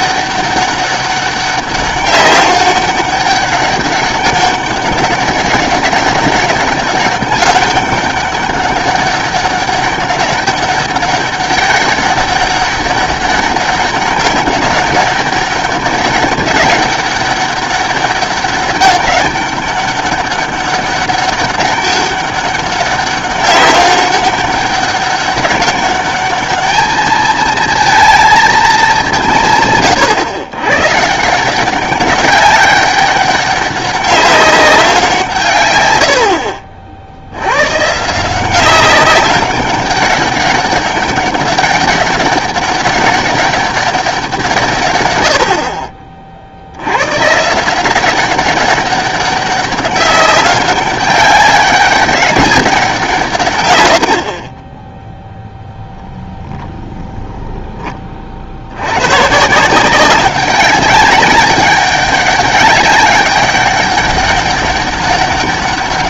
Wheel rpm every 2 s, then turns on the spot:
200, 200, 200, 200, 200, 200, 190, 200, 200, 200, 200, 200, 200, 210, 220, 130, 200, 190, 60, 190, 200, 200, 150, 70, 190, 200, 190, 20, 0, 80, 200, 200, 200.
none